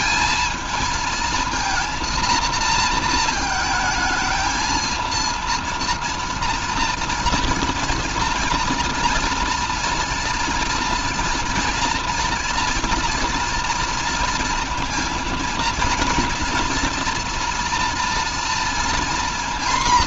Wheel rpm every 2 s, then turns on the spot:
220, 230, 220, 230, 230, 230, 230, 230, 230, 230.
none